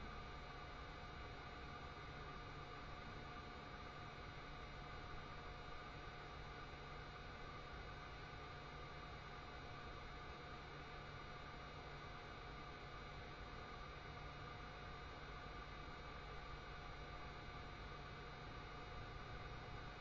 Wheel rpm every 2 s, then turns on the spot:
0, 0, 0, 0, 0, 0, 0, 0, 0, 0.
none